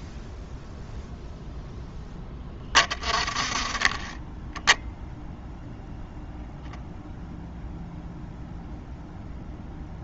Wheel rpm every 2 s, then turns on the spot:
0, 30, 0, 0, 0.
none